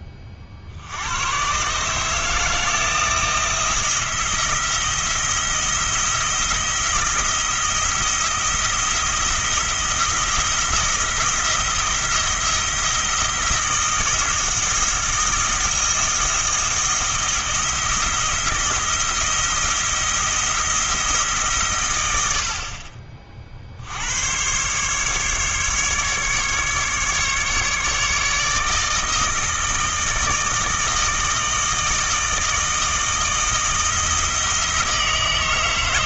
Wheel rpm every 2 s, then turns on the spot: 60, 160, 170, 160, 170, 170, 170, 160, 170, 170, 170, 40, 130, 150, 160, 160, 160, 160.
none